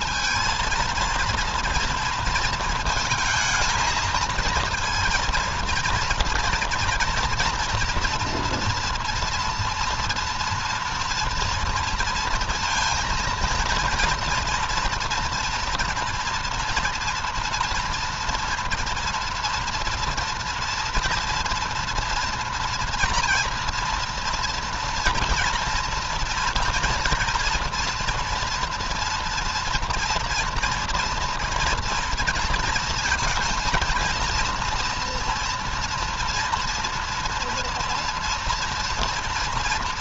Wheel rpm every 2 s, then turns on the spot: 230, 220, 230, 240, 240, 230, 230, 230, 230, 230, 230, 230, 240, 230, 230, 230, 230, 230, 230, 230.
none